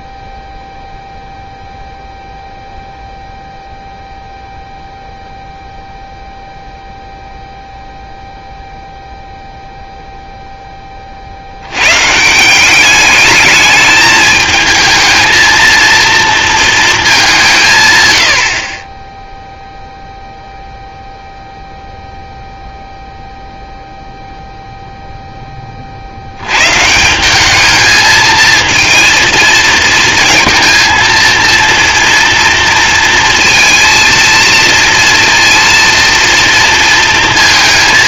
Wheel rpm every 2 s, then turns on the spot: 0, 0, 0, 0, 0, 10, 180, 220, 230, 50, 0, 0, 0, 110, 220, 230, 230, 230, 230.
none